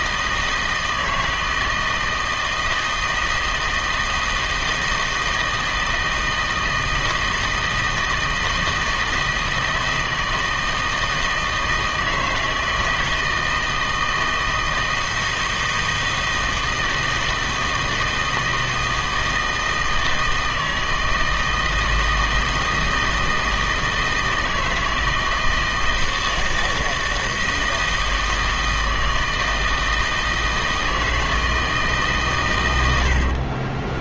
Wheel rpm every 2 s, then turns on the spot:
160, 160, 160, 160, 160, 160, 160, 160, 160, 160, 160, 160, 160, 160, 160, 160, 120.
none